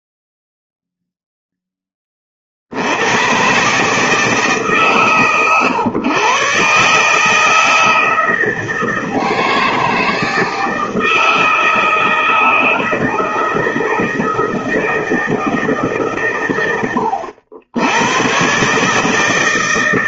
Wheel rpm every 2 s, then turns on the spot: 0, 90, 140, 140, 160, 160, 160, 160, 100, 150.
none